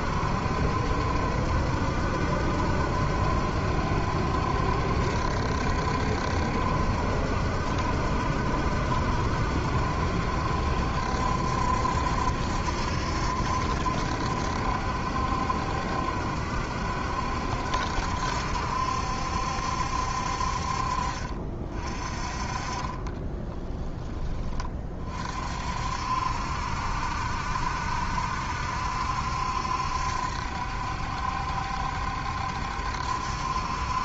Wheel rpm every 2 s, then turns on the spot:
70, 70, 70, 70, 70, 70, 70, 70, 70, 70, 50, 30, 30, 70, 70, 70, 70.
none